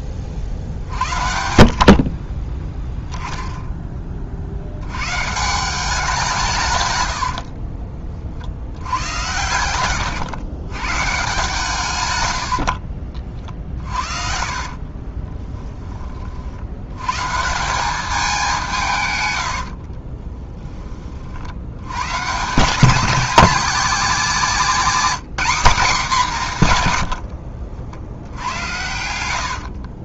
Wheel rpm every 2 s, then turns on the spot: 50, 10, 80, 150, 80, 120, 60, 40, 80, 180, 20, 180, 240, 160, 90.
12-16 24-26 28-30